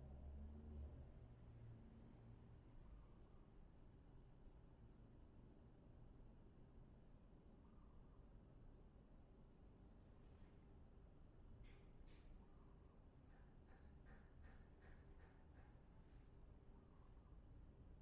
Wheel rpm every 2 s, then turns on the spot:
0, 0, 0, 0, 0, 0, 0, 0, 0.
none